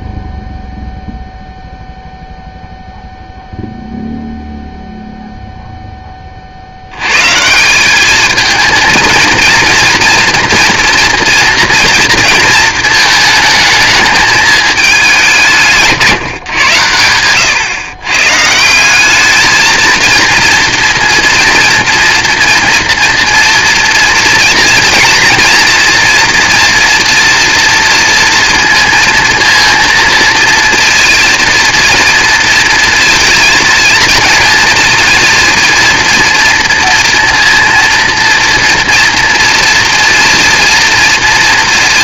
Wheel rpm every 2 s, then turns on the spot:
0, 0, 0, 70, 220, 240, 220, 210, 120, 150, 230, 240, 230, 240, 230, 230, 230, 230, 230, 240, 230.
none